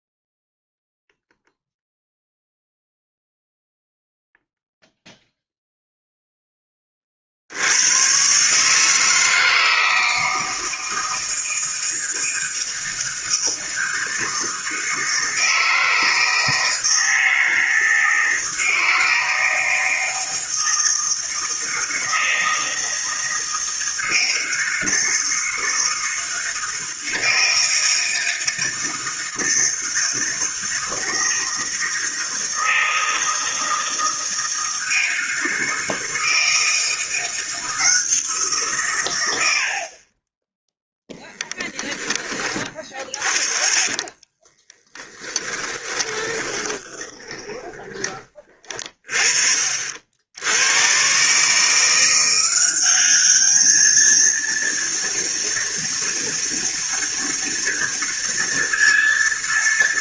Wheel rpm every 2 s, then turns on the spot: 0, 0, 0, 30, 150, 160, 160, 160, 160, 160, 160, 160, 160, 160, 160, 160, 160, 160, 170, 130, 10, 20, 20, 20, 40, 110, 190, 230, 230, 230.
44-48